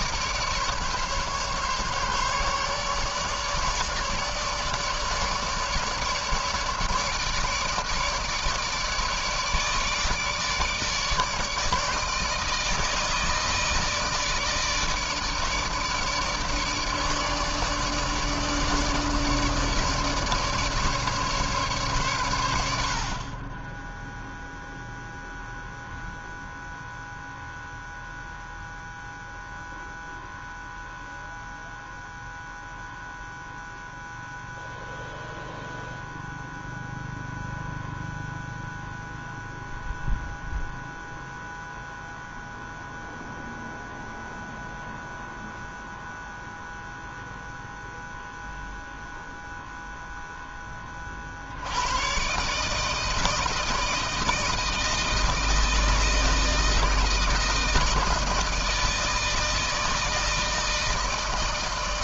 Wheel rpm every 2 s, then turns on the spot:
150, 150, 150, 150, 150, 150, 160, 150, 150, 150, 150, 60, 0, 0, 0, 0, 0, 0, 0, 0, 0, 0, 0, 0, 0, 30, 150, 160, 160, 160, 160.
none